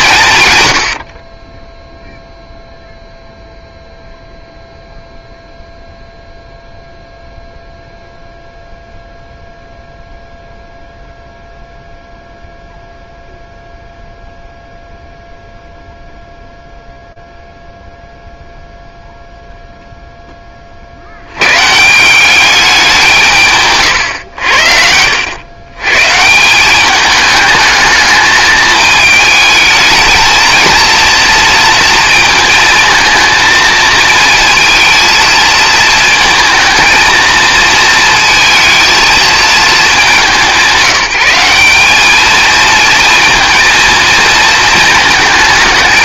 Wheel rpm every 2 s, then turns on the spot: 120, 0, 0, 0, 0, 0, 0, 0, 0, 0, 30, 200, 80, 180, 220, 230, 220, 230, 220, 220, 180, 220, 220.
none